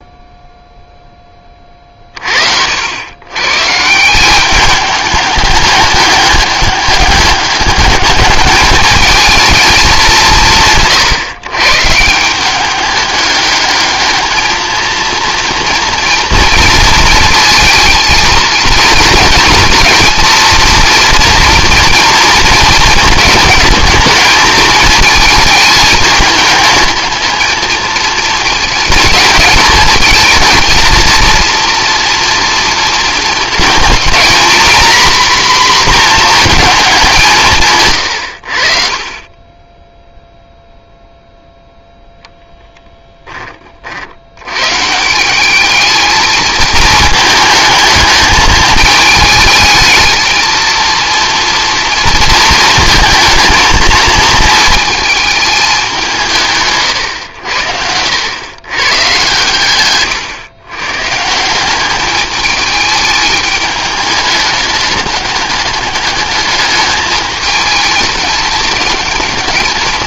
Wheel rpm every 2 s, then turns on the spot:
10, 90, 210, 200, 210, 130, 200, 230, 220, 230, 230, 220, 220, 220, 220, 230, 220, 240, 210, 40, 0, 0, 130, 220, 220, 230, 220, 220, 100, 120, 120, 210, 210, 210, 210.
none